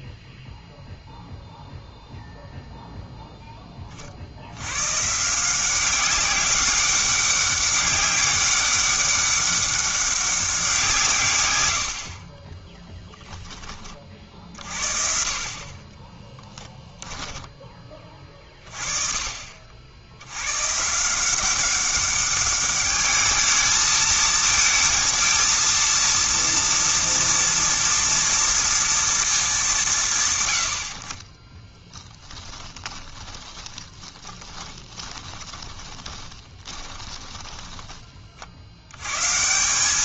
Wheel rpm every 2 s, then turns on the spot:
0, 0, 100, 200, 200, 180, 20, 60, 10, 30, 120, 200, 230, 230, 230, 100, 20, 20, 20, 70.
12-14 16-18 32-38